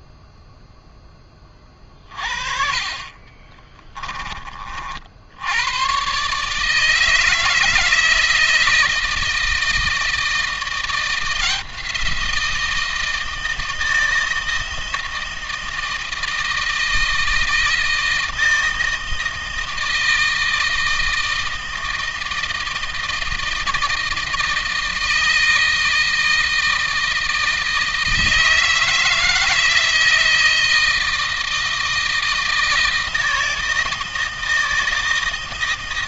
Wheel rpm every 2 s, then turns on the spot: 10, 40, 60, 160, 160, 170, 170, 160, 160, 160, 160, 160, 160, 160, 160, 160, 160, 160.
none